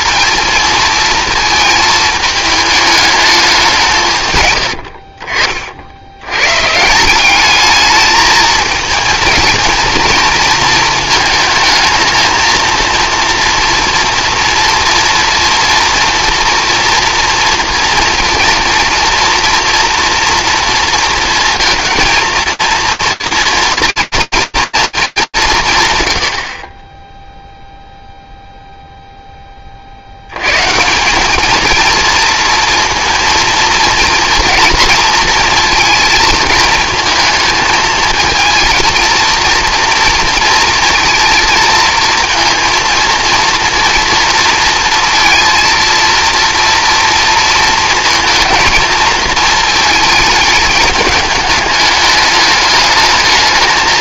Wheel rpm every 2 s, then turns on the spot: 230, 210, 100, 130, 230, 230, 230, 230, 230, 230, 230, 230, 230, 60, 0, 150, 230, 230, 230, 230, 230, 230, 230, 230, 220, 210, 210.
none